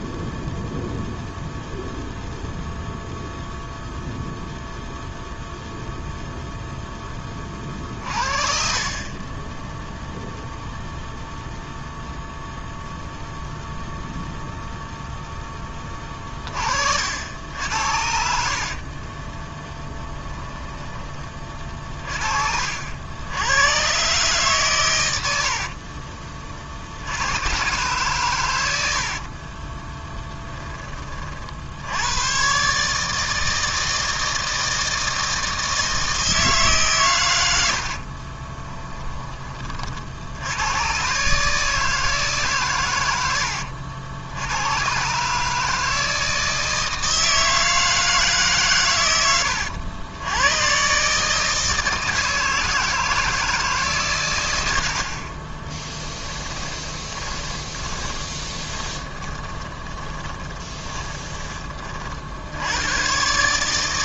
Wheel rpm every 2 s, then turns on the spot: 0, 0, 0, 10, 30, 0, 0, 0, 50, 40, 20, 70, 110, 70, 80, 20, 150, 160, 130, 20, 120, 110, 130, 160, 120, 130, 160, 60, 20, 30, 20, 100.
18-20 38-40 56-62